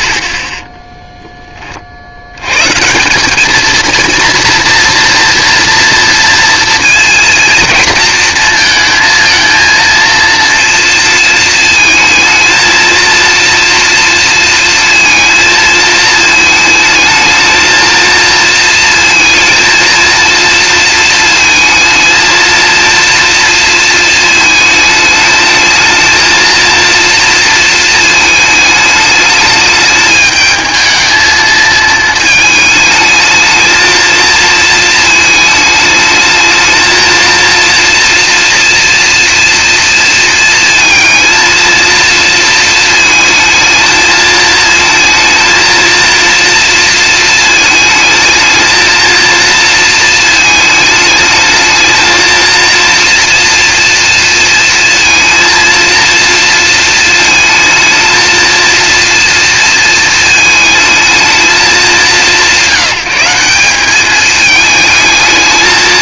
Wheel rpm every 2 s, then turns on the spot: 10, 150, 230, 230, 230, 230, 230, 230, 220, 230, 230, 230, 220, 230, 210, 220, 220, 220, 220, 240, 230, 220, 230, 230, 230, 220, 230, 230, 220, 230, 220, 170, 220.
none